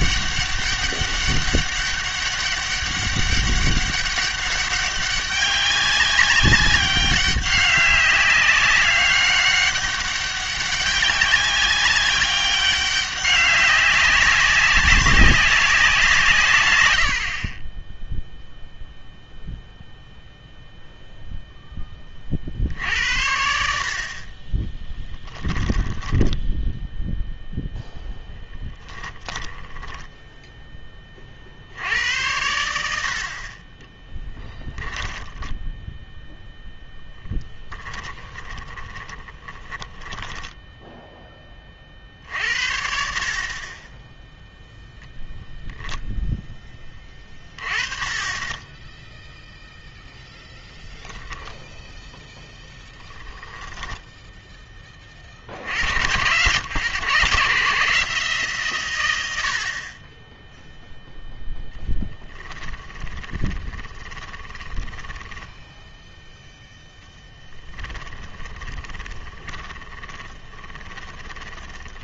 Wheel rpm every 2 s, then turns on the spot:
200, 200, 200, 200, 200, 190, 200, 200, 120, 0, 0, 70, 10, 0, 10, 10, 80, 10, 0, 20, 10, 50, 0, 10, 10, 10, 10, 20, 120, 120, 0, 10, 10, 0, 20, 30.
24-26 28-30 34-36 38-42 52-54 62-66 68-72